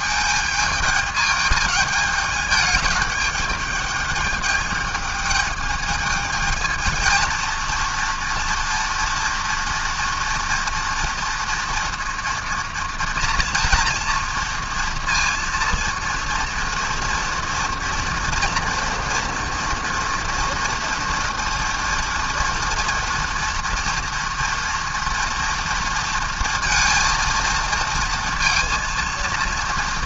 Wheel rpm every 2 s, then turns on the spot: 210, 210, 210, 230, 230, 230, 240, 230, 230, 240, 230, 240, 230, 230, 230.
none